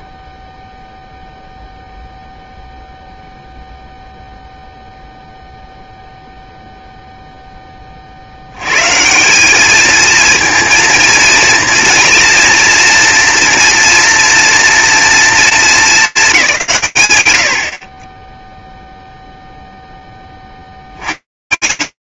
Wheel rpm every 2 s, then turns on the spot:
0, 0, 0, 0, 160, 230, 230, 230, 120, 0, 140.
none